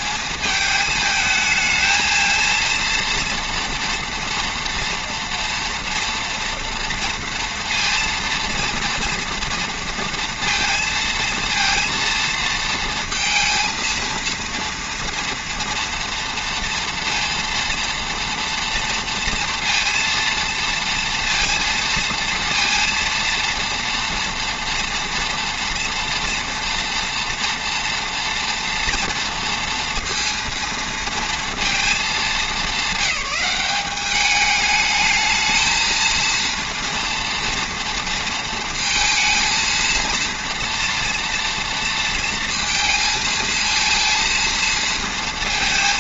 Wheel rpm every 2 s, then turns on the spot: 220, 230, 230, 240, 230, 230, 220, 230, 240, 230, 230, 230, 230, 240, 230, 230, 200, 210, 230, 220, 230, 230, 230.
none